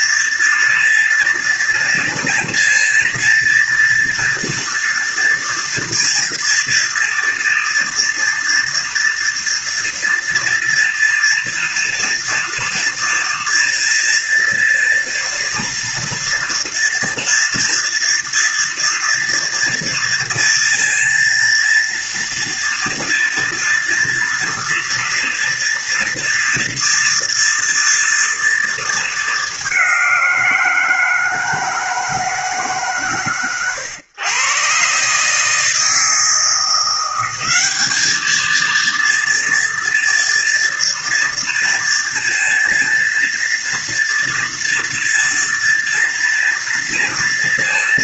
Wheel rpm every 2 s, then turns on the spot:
230, 230, 230, 230, 230, 230, 230, 230, 230, 240, 230, 230, 230, 230, 230, 180, 150, 130, 170, 220, 230, 230, 230, 230.
none